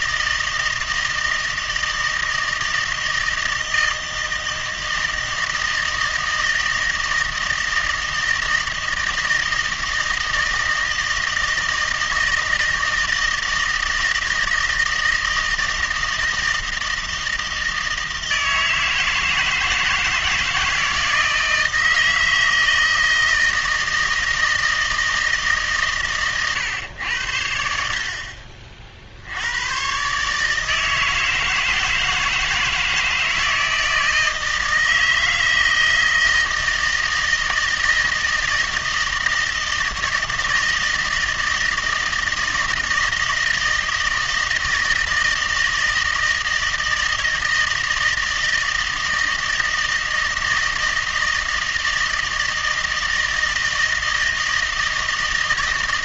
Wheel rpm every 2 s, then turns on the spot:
160, 160, 160, 160, 160, 160, 160, 160, 160, 160, 160, 160, 160, 110, 50, 160, 160, 160, 160, 160, 160, 160, 160, 160, 160, 160, 160, 160.
none